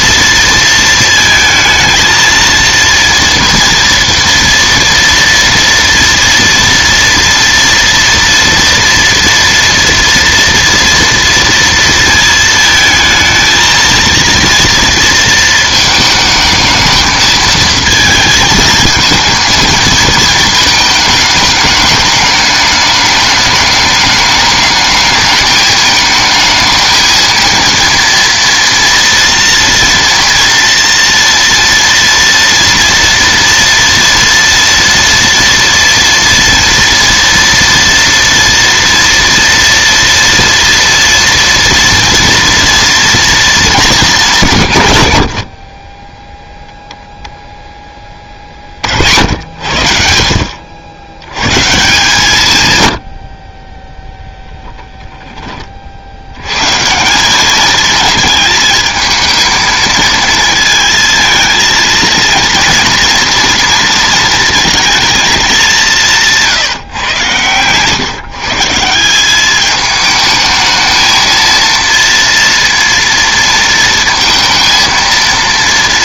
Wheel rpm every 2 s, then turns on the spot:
230, 230, 230, 240, 230, 230, 220, 230, 220, 220, 220, 210, 210, 220, 230, 230, 230, 230, 230, 230, 230, 230, 130, 0, 60, 80, 90, 10, 160, 220, 230, 230, 220, 130, 170, 220, 230, 230.
none